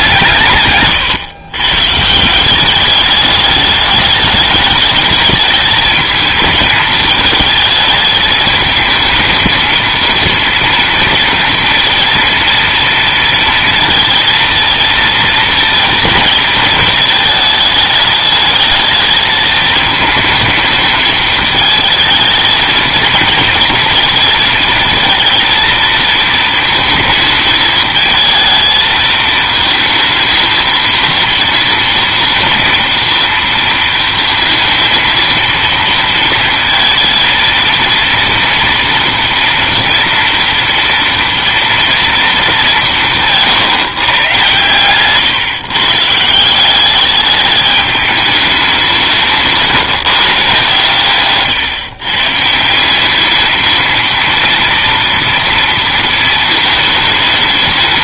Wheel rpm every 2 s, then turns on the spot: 140, 180, 210, 220, 220, 230, 230, 220, 230, 220, 220, 220, 230, 220, 220, 230, 230, 230, 230, 230, 230, 200, 120, 180, 200, 140, 150, 240, 220.
none